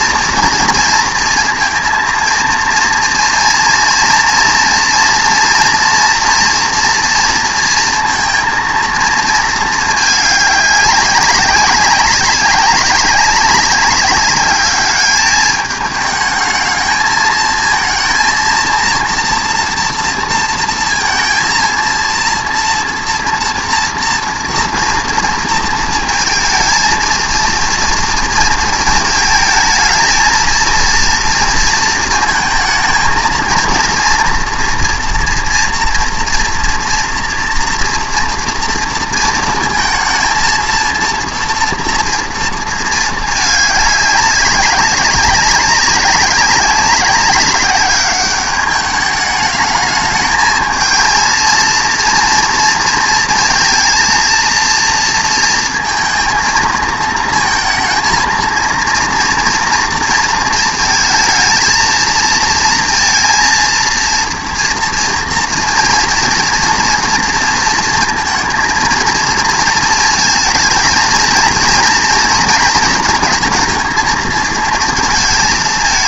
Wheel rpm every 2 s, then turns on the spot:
230, 230, 230, 230, 230, 200, 200, 210, 220, 230, 230, 230, 230, 230, 230, 230, 220, 230, 230, 230, 230, 230, 190, 190, 200, 220, 230, 230, 230, 230, 230, 230, 240, 230, 230, 220, 230, 230.
none